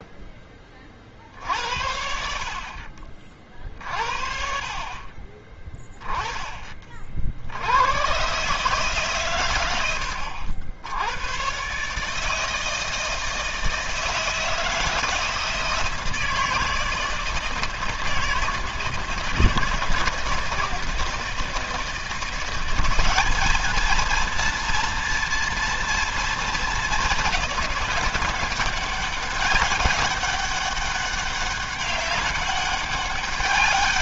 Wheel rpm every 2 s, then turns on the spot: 40, 40, 40, 30, 140, 90, 160, 160, 160, 160, 160, 180, 230, 210, 190, 200, 200.
none